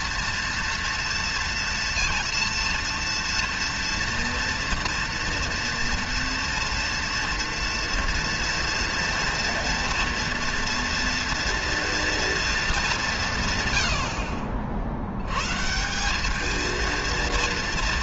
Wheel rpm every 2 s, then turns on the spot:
230, 240, 240, 230, 230, 230, 210, 70, 220.
none